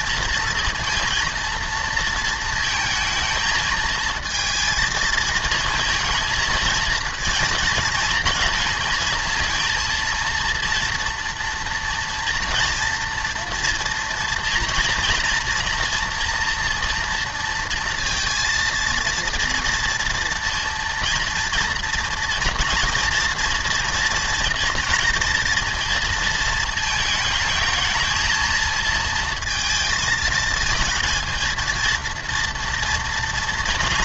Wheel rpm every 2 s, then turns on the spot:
230, 230, 220, 230, 230, 230, 230, 230, 230, 230, 230, 230, 240, 220, 230, 220, 230.
none